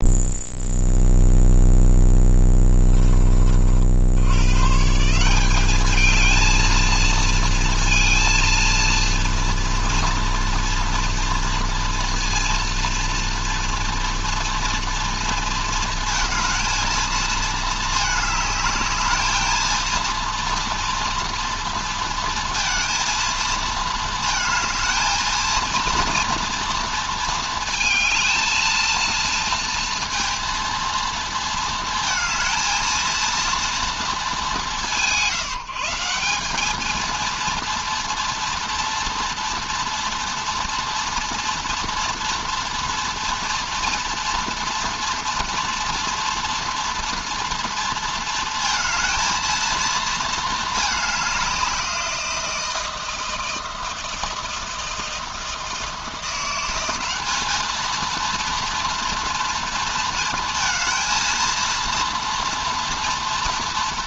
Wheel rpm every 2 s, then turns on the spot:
0, 20, 150, 220, 230, 240, 240, 240, 230, 210, 240, 230, 220, 230, 230, 230, 230, 170, 230, 230, 230, 230, 240, 240, 230, 210, 170, 160, 190, 230, 230, 240.
none